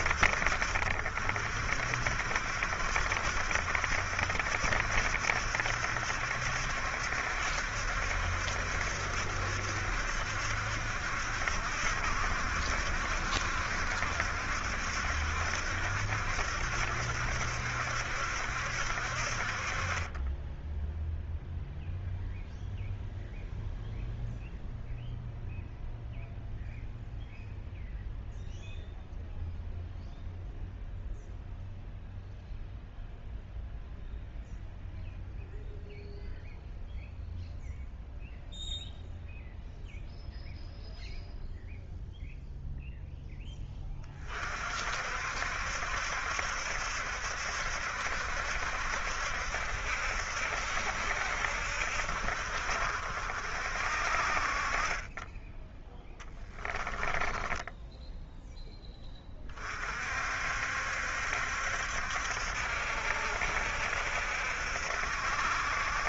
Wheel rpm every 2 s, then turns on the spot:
60, 70, 70, 70, 70, 70, 70, 70, 70, 60, 10, 0, 0, 0, 0, 0, 0, 0, 0, 0, 0, 0, 50, 70, 70, 70, 60, 30, 10, 10, 60, 70, 70.
56-58